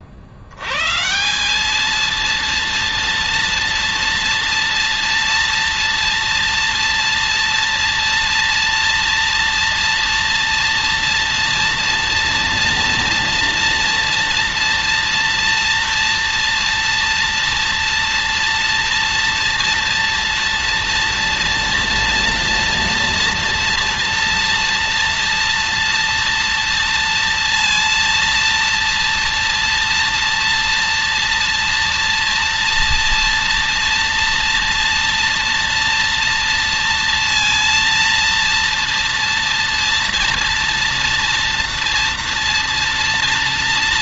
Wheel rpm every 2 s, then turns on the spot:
130, 230, 230, 230, 230, 230, 230, 240, 230, 230, 240, 230, 230, 230, 230, 230, 230, 240, 230, 230, 230, 230.
none